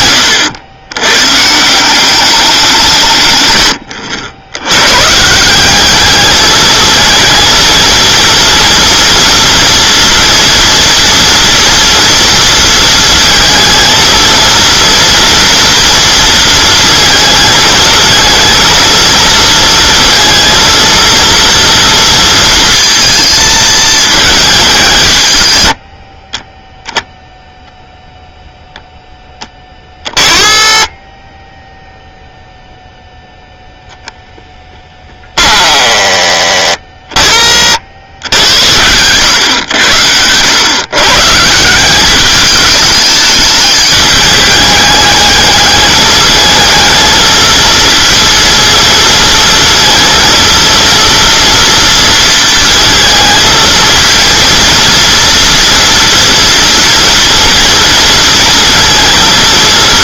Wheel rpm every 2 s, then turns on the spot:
90, 180, 110, 220, 230, 240, 230, 230, 230, 230, 230, 230, 200, 10, 0, 20, 0, 10, 20, 80, 120, 210, 210, 220, 230, 230, 230, 230, 230, 230.
none